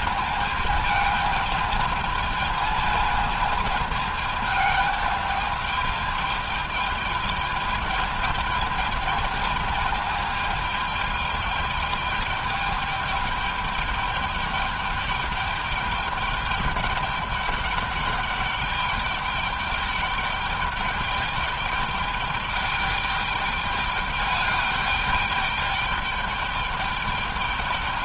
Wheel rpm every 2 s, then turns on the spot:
210, 220, 210, 210, 210, 210, 210, 210, 210, 210, 210, 210, 210, 210.
none